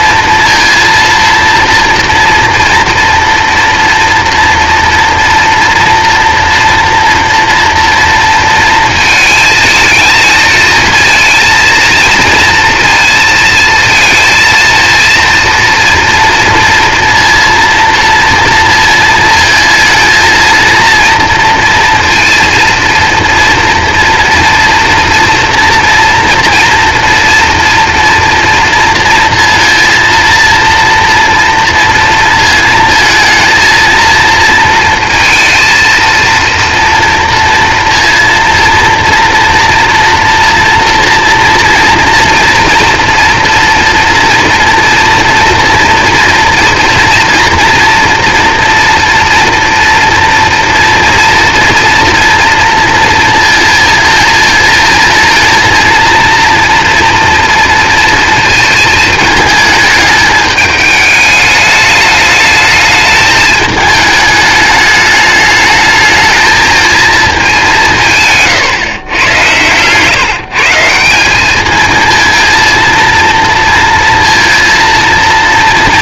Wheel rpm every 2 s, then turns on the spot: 230, 230, 240, 240, 230, 220, 230, 230, 230, 230, 230, 230, 240, 240, 230, 230, 230, 230, 230, 230, 230, 230, 230, 230, 230, 230, 230, 220, 230, 220, 210, 210, 210, 220, 140, 160, 230, 230.
none